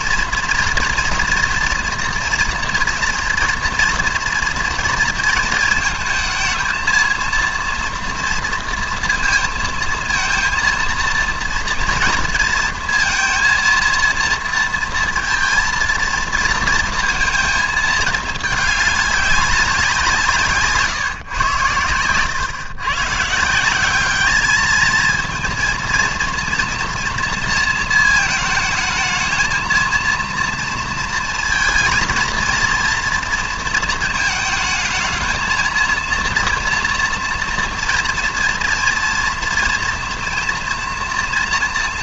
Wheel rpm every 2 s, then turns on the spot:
230, 230, 230, 220, 230, 230, 230, 230, 230, 210, 150, 120, 220, 230, 220, 230, 230, 220, 230, 230, 230.
none